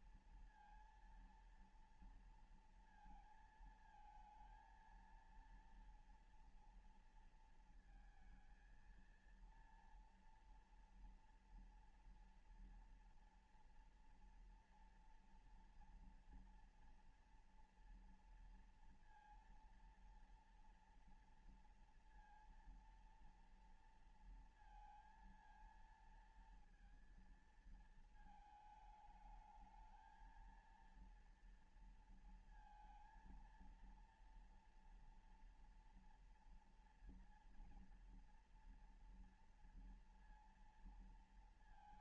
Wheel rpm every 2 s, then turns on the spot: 230, 230, 230, 230, 230, 230, 230, 230, 230, 230, 230, 230, 230, 230, 220, 220, 230, 230, 240, 230, 230.
none